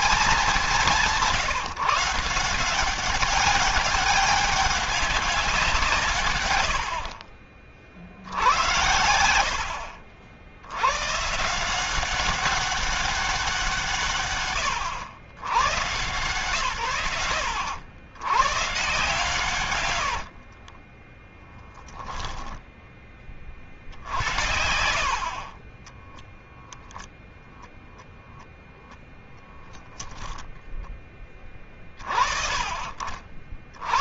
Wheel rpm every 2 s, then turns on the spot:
180, 190, 200, 60, 100, 120, 190, 110, 100, 150, 10, 20, 70, 0, 0, 20, 50.
18-22